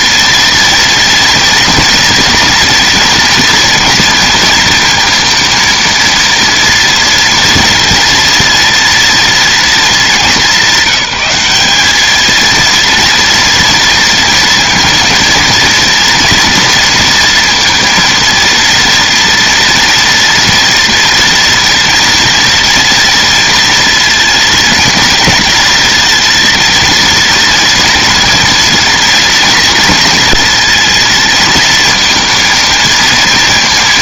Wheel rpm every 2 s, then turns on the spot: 230, 240, 230, 230, 230, 200, 230, 230, 230, 230, 230, 230, 230, 230, 240, 230, 230.
none